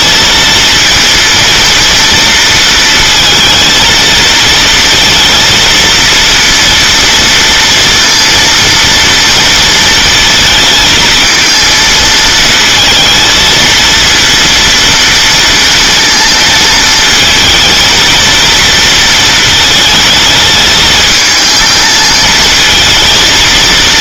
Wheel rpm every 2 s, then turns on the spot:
230, 230, 230, 230, 230, 230, 230, 230, 230, 230, 220, 220.
none